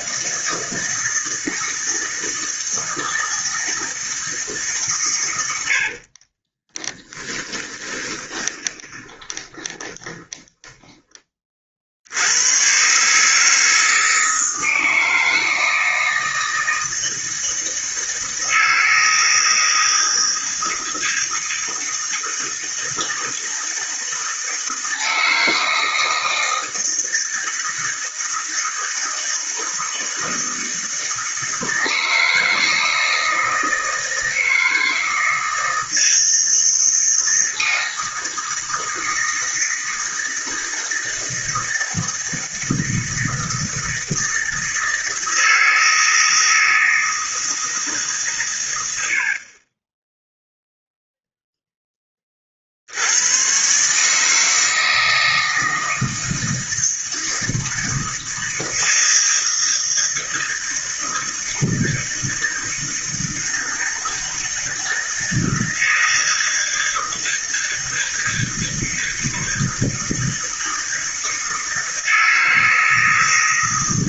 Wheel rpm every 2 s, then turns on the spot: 160, 160, 140, 20, 20, 10, 120, 160, 160, 160, 160, 160, 160, 160, 160, 160, 160, 160, 160, 160, 160, 160, 160, 160, 100, 0, 60, 160, 160, 160, 160, 160, 160, 160, 160, 160, 160.
6-12